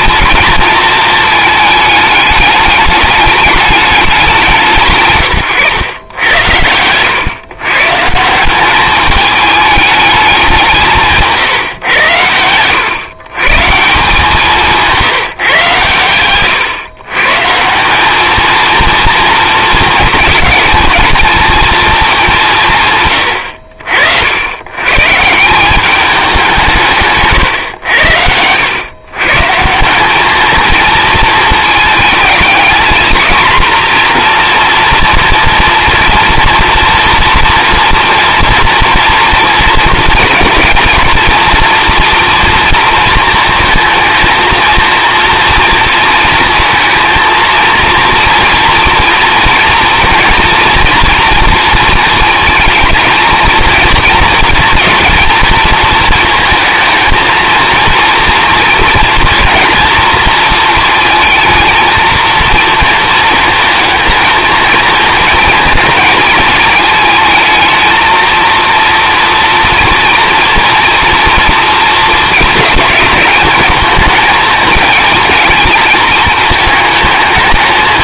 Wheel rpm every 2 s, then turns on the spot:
230, 210, 160, 100, 200, 180, 110, 170, 130, 220, 230, 160, 100, 160, 100, 220, 230, 230, 230, 230, 230, 230, 230, 230, 240, 230, 220, 230, 230, 230, 230, 230, 220, 220, 230, 230, 220, 220, 220.
none